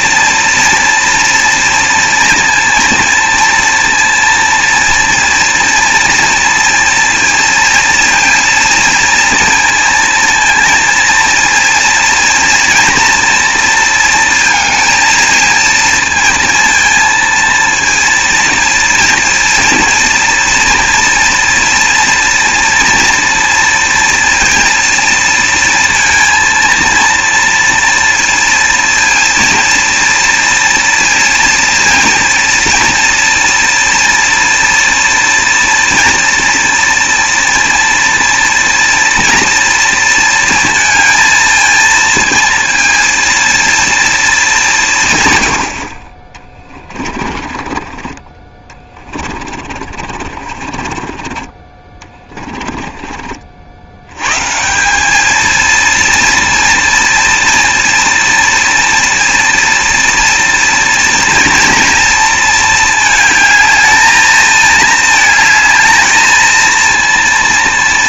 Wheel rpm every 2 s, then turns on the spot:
230, 230, 230, 230, 230, 230, 230, 220, 220, 230, 230, 230, 230, 230, 230, 230, 230, 230, 230, 230, 230, 230, 180, 20, 20, 40, 30, 160, 230, 230, 230, 220, 220, 230.
46-54